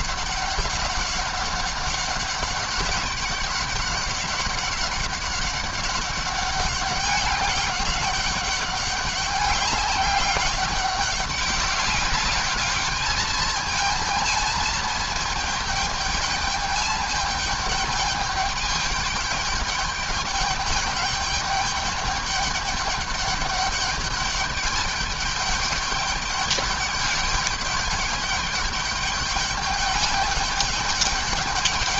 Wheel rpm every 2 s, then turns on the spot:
200, 200, 200, 200, 200, 200, 210, 220, 210, 210, 200, 210, 210, 210, 210, 210.
none